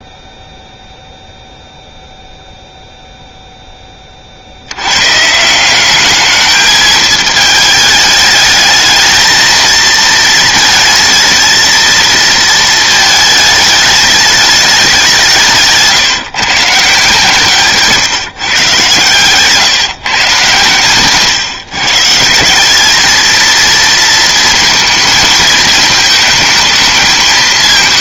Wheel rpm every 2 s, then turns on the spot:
0, 0, 80, 220, 220, 220, 220, 200, 150, 130, 130, 190, 220, 220.
none